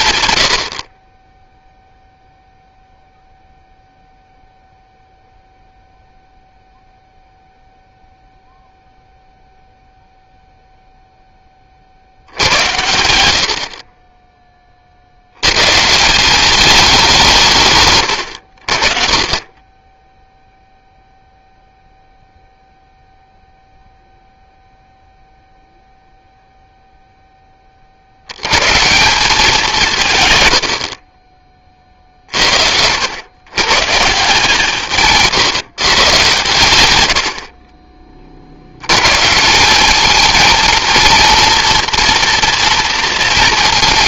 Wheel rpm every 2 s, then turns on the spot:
100, 0, 0, 0, 0, 0, 90, 20, 180, 100, 0, 0, 0, 0, 90, 130, 40, 160, 140, 50, 220, 230.
none